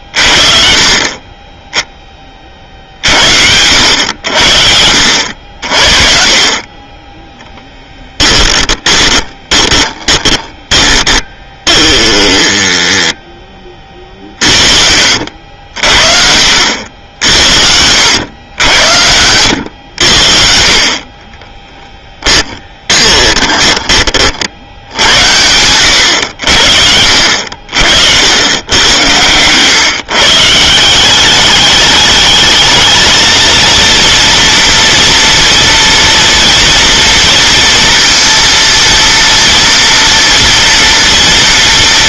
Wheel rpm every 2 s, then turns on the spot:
40, 50, 70, 30, 10, 10, 10, 50, 80, 90, 50, 20, 70, 70, 100, 170, 220, 230, 230, 230, 230.
8-12 22-24